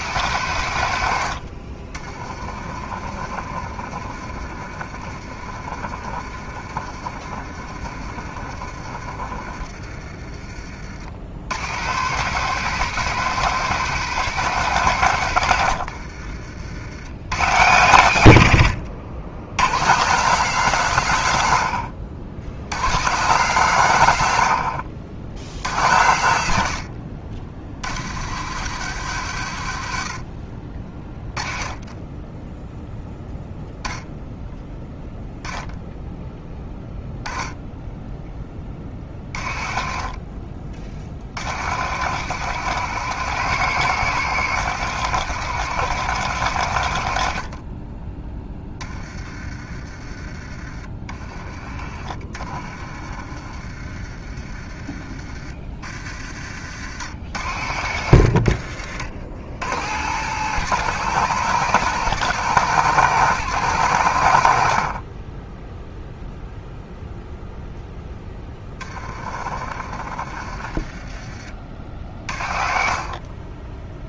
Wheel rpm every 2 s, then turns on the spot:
120, 40, 50, 50, 40, 40, 190, 180, 60, 100, 170, 100, 80, 80, 120, 40, 0, 10, 10, 20, 40, 130, 130, 110, 20, 30, 40, 30, 70, 70, 130, 140, 60, 0, 20, 30, 40.
2-10 50-54 56-58 68-72